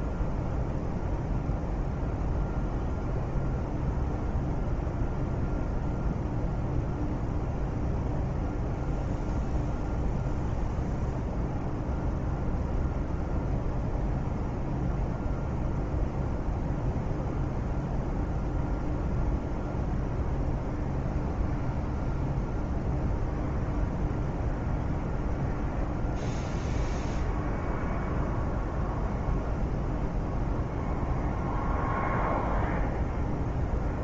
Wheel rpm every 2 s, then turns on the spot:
0, 0, 0, 0, 0, 0, 0, 0, 0, 0, 0, 0, 0, 0, 0, 0, 0.
none